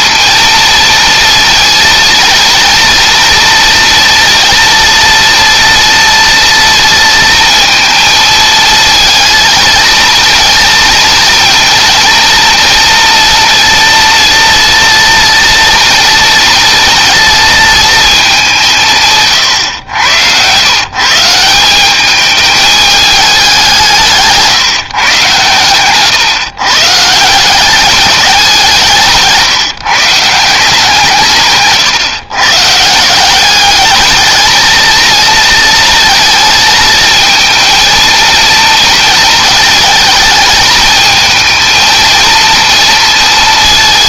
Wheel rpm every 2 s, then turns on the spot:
230, 230, 230, 230, 230, 230, 230, 230, 230, 180, 140, 210, 150, 150, 170, 170, 140, 220, 230, 230, 220, 230.
none